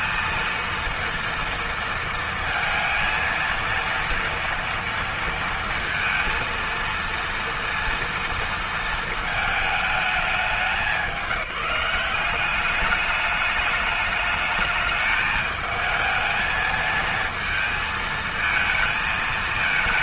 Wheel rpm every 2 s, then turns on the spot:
230, 230, 230, 230, 220, 180, 200, 210, 230, 220.
none